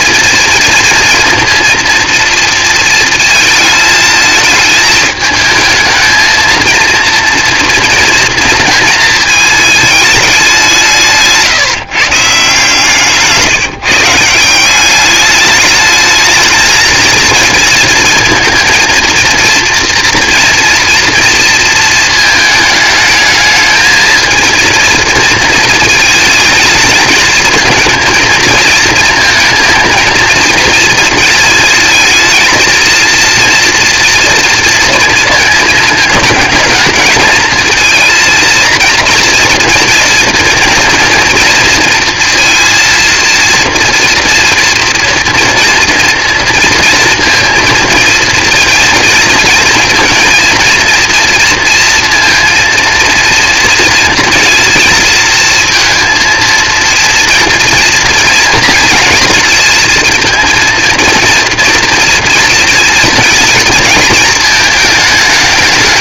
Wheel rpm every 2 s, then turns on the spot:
230, 230, 220, 230, 230, 180, 150, 190, 220, 230, 230, 220, 230, 220, 230, 230, 230, 230, 220, 230, 230, 230, 240, 230, 230, 230, 230, 230, 230, 220, 230, 230, 220.
none